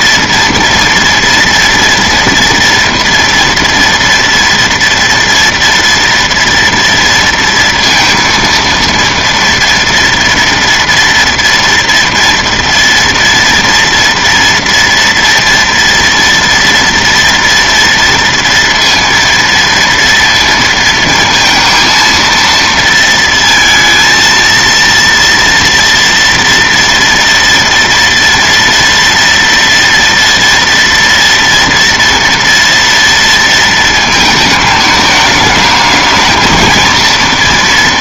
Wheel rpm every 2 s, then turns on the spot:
230, 230, 230, 230, 230, 230, 230, 230, 230, 230, 230, 230, 230, 230, 230, 230, 230, 220, 220.
none